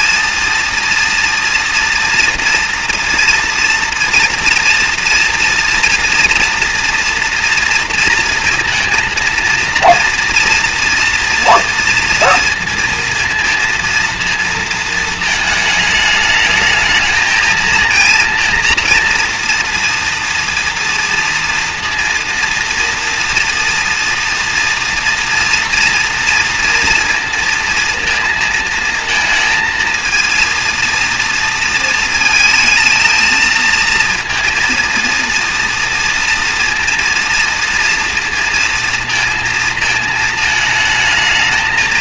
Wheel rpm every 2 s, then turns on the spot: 230, 230, 230, 230, 230, 230, 230, 230, 220, 230, 230, 230, 230, 230, 230, 230, 230, 230, 230, 230, 220.
none